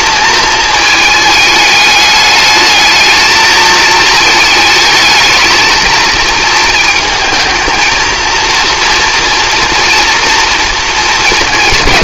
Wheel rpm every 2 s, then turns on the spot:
220, 210, 220, 220, 230, 230.
none